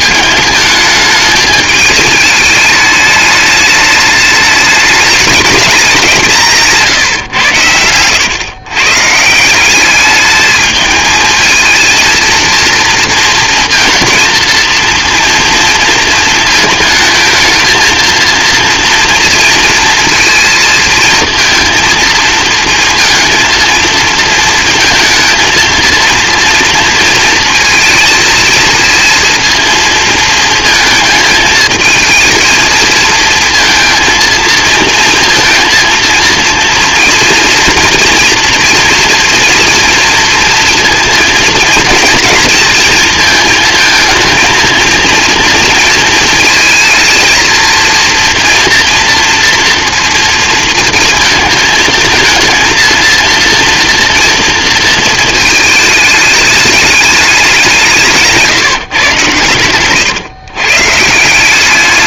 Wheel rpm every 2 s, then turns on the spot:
210, 210, 210, 160, 130, 220, 230, 230, 220, 230, 230, 230, 220, 230, 230, 230, 220, 230, 230, 230, 230, 230, 230, 230, 230, 230, 230, 230, 210, 130, 140.
6-8